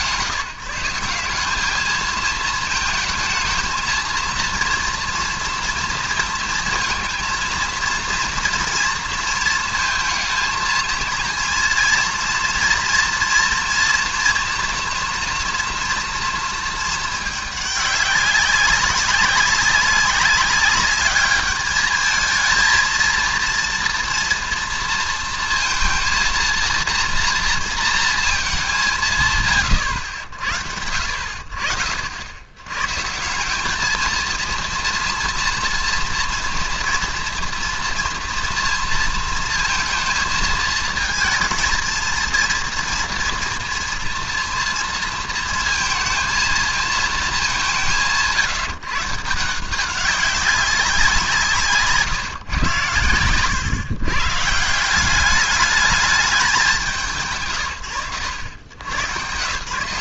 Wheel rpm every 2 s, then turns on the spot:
170, 220, 230, 230, 230, 220, 230, 230, 220, 190, 200, 220, 230, 230, 190, 70, 130, 230, 230, 230, 220, 230, 230, 220, 150, 180, 120, 180, 210, 90.
none